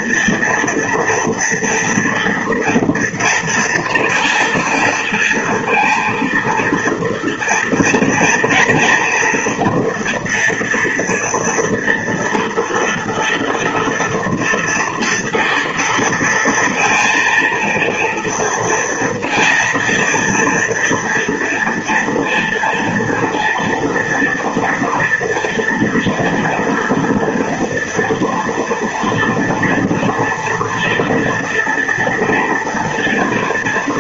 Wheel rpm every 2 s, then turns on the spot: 230, 230, 230, 230, 230, 230, 230, 230, 230, 230, 240, 230, 230, 240, 230, 240, 230.
none